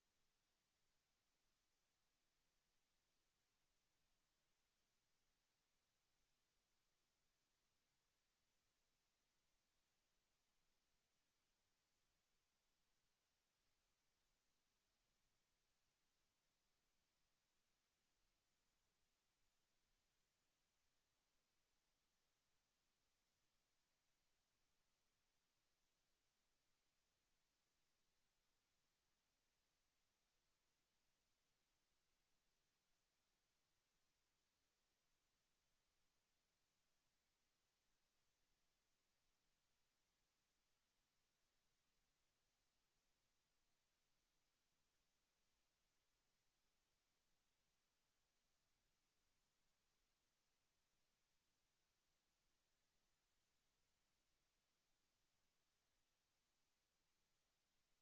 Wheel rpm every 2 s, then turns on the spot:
0, 0, 0, 0, 0, 0, 0, 0, 0, 0, 0, 0, 0, 0, 0, 0, 0, 0, 0, 0, 0, 0, 0, 0, 0, 0, 0, 0, 0.
none